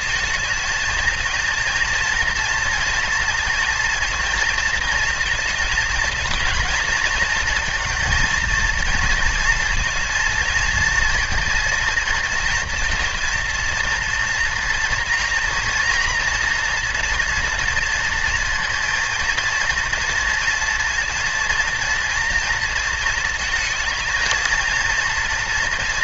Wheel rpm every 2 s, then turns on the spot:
220, 230, 230, 230, 230, 230, 230, 240, 240, 230, 230, 230, 230.
none